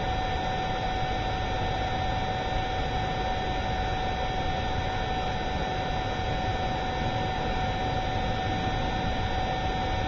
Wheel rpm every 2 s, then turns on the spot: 0, 0, 0, 0, 0.
none